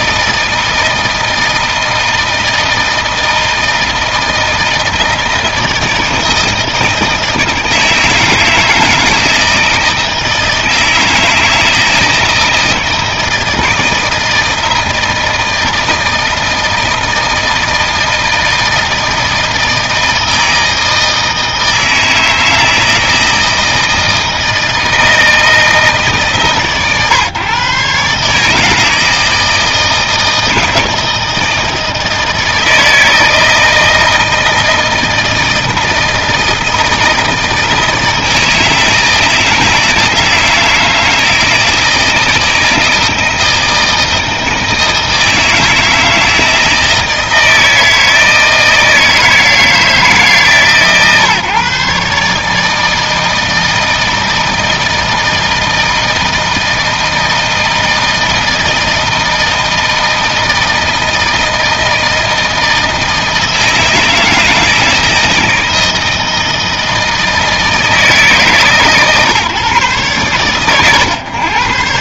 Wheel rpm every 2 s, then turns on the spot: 160, 160, 160, 160, 160, 160, 160, 160, 160, 160, 160, 160, 160, 150, 140, 160, 160, 160, 160, 160, 160, 160, 160, 160, 160, 150, 140, 160, 160, 160, 160, 160, 160, 160, 150, 110.
none